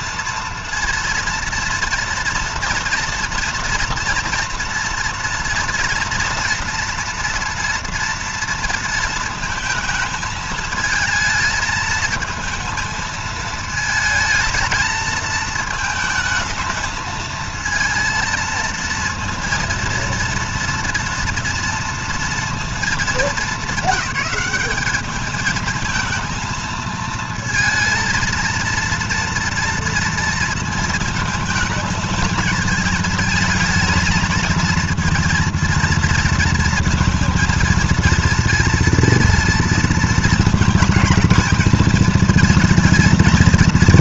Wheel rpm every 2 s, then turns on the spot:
230, 230, 230, 240, 230, 220, 220, 220, 220, 230, 230, 230, 210, 230, 230, 230, 230, 230, 230, 230, 230, 230.
none